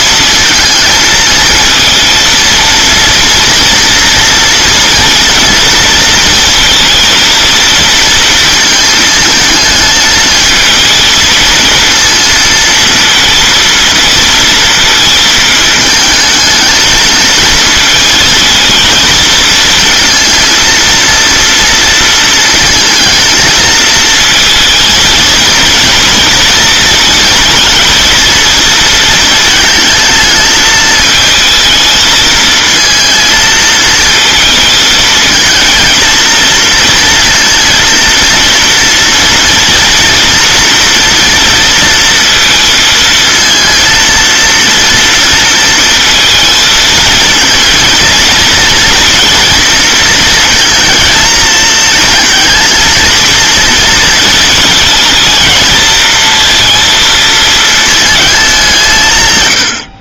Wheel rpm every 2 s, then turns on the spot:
230, 230, 240, 230, 220, 220, 230, 220, 220, 230, 230, 230, 230, 230, 230, 220, 230, 220, 230, 230, 230, 230, 230, 220, 230, 230, 230, 220, 230, 160.
none